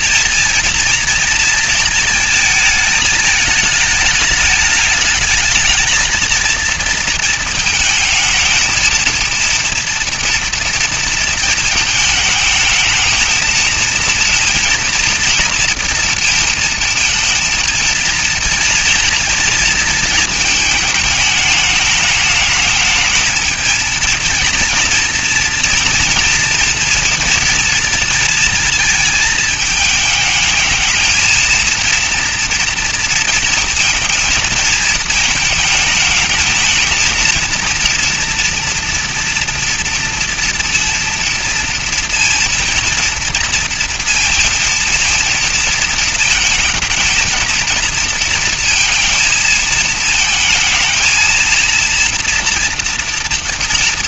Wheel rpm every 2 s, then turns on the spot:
230, 220, 210, 230, 230, 230, 220, 230, 230, 230, 220, 220, 230, 230, 220, 220, 230, 220, 220, 230, 230, 230, 230, 220, 230, 220, 240.
none